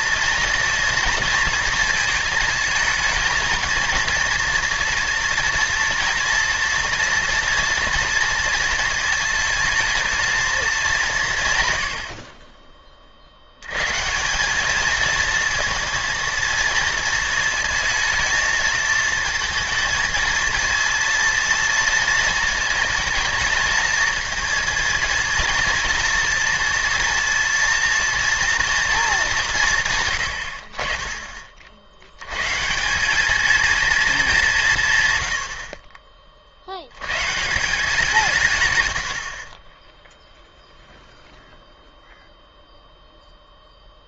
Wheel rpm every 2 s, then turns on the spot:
240, 230, 230, 240, 230, 220, 30, 210, 230, 220, 230, 220, 230, 240, 230, 80, 150, 170, 70, 130, 0, 0.
12-14